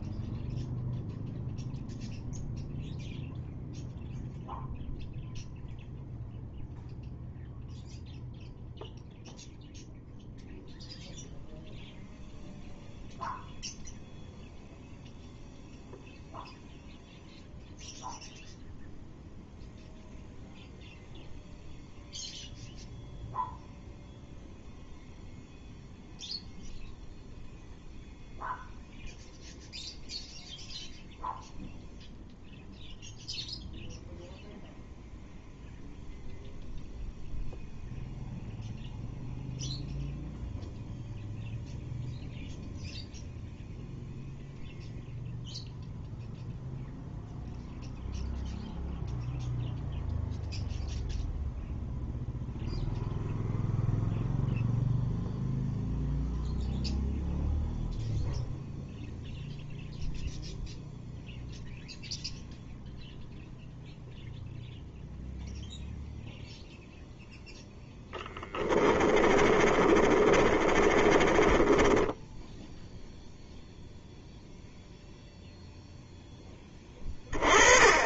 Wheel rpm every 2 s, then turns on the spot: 0, 0, 0, 0, 0, 0, 0, 0, 0, 0, 0, 0, 0, 0, 0, 0, 0, 0, 0, 0, 0, 0, 0, 0, 0, 0, 0, 0, 0, 0, 0, 0, 0, 0, 20, 30, 0, 0, 20.
68-72